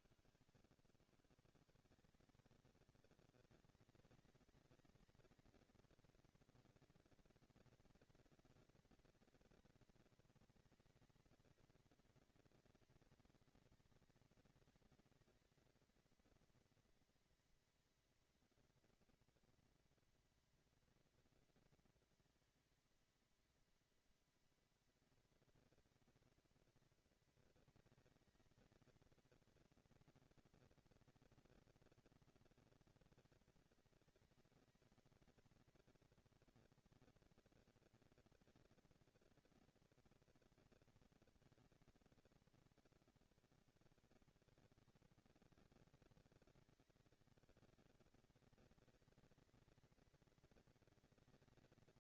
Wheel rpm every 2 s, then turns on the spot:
110, 180, 210, 230, 230, 230, 230, 230, 230, 240, 230, 230, 230, 230, 220, 230, 230, 220, 230, 230, 230, 230, 200, 200, 210, 230.
0-2